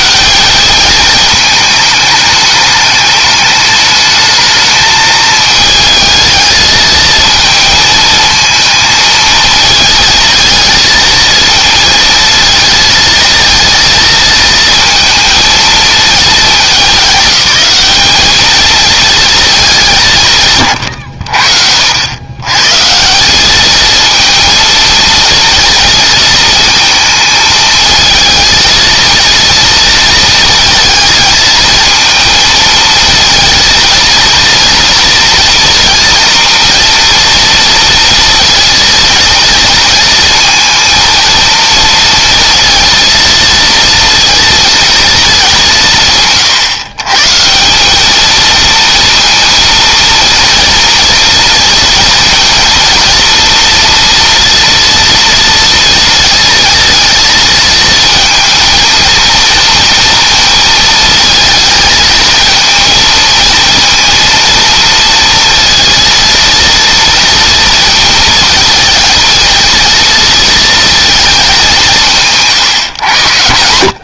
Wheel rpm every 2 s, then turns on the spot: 210, 210, 220, 220, 220, 220, 220, 230, 200, 220, 120, 160, 220, 220, 230, 220, 230, 230, 230, 230, 230, 230, 230, 130, 230, 230, 240, 230, 230, 230, 230, 230, 230, 230, 220, 220, 130.
none